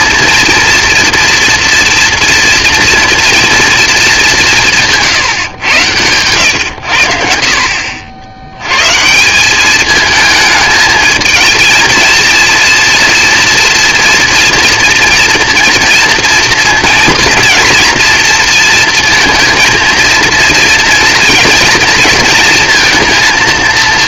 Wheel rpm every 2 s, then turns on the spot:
230, 230, 140, 70, 170, 220, 240, 230, 230, 230, 230, 230.
none